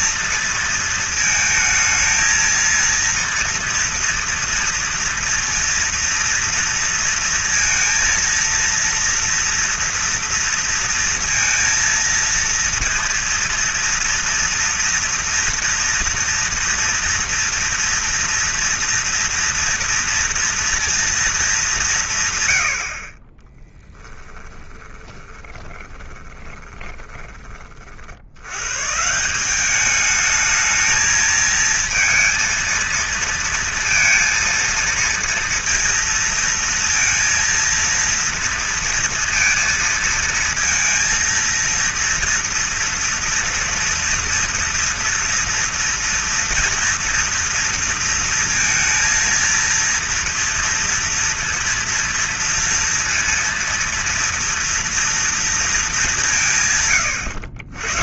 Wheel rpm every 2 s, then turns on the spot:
230, 230, 230, 230, 230, 230, 230, 230, 230, 230, 230, 60, 10, 20, 130, 220, 230, 230, 230, 230, 230, 230, 230, 230, 230, 230, 230, 230, 140.
24-28